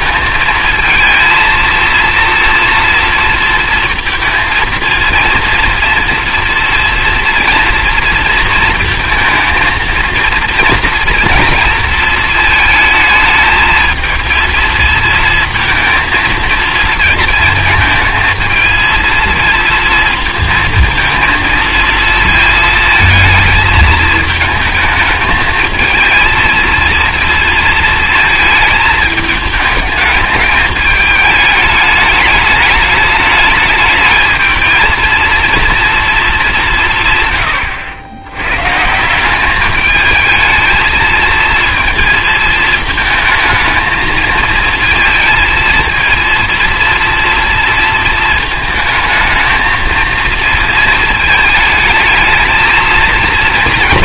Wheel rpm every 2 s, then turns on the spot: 220, 230, 230, 230, 230, 230, 220, 230, 230, 230, 230, 230, 220, 230, 220, 210, 210, 220, 190, 130, 220, 230, 230, 240, 220, 220, 220.
none